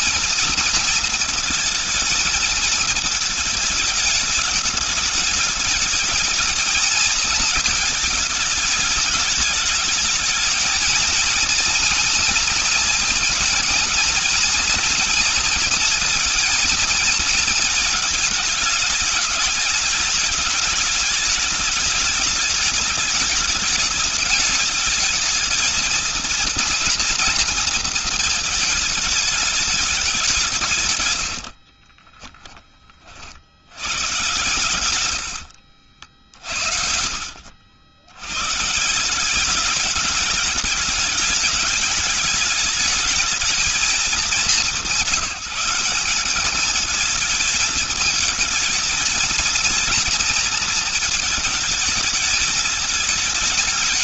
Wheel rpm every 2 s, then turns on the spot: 230, 220, 210, 220, 210, 220, 240, 230, 230, 210, 210, 210, 210, 230, 220, 140, 30, 110, 80, 160, 210, 210, 190, 210, 220, 220, 220.
30-32 34-38